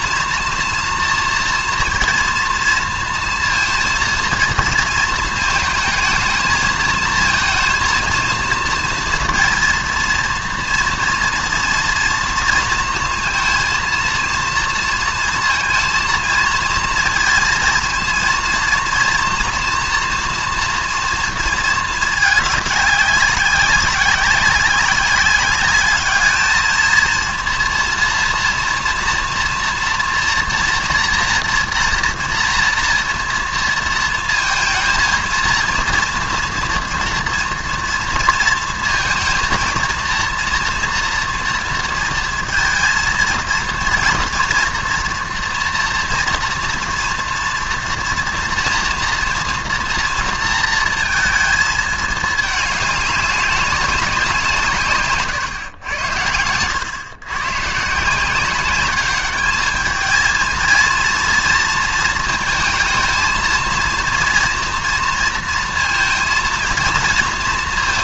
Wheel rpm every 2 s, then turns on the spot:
230, 230, 230, 220, 230, 230, 230, 230, 230, 230, 230, 200, 200, 230, 230, 240, 230, 220, 230, 230, 230, 230, 230, 230, 240, 230, 210, 150, 100, 190, 230, 230, 230, 230.
none